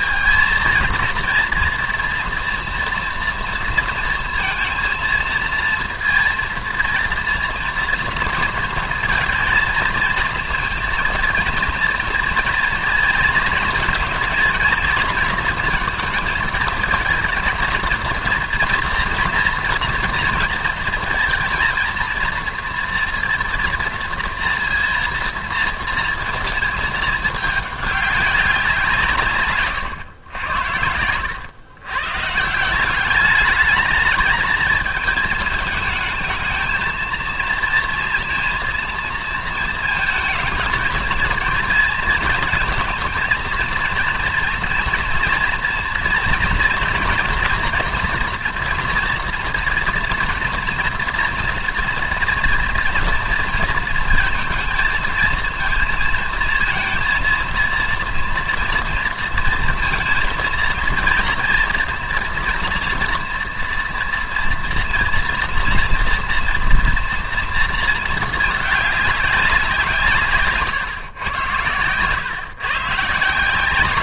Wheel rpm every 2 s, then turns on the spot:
230, 230, 230, 230, 230, 230, 230, 230, 230, 230, 230, 230, 230, 220, 160, 100, 190, 220, 220, 230, 230, 230, 230, 240, 230, 230, 230, 230, 230, 230, 230, 230, 230, 230, 200, 140, 150.
none